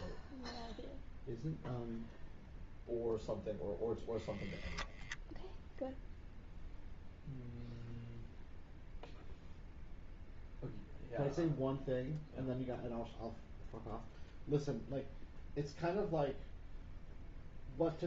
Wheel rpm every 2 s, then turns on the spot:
0, 0, 0, 0, 0, 0, 0, 0, 0.
none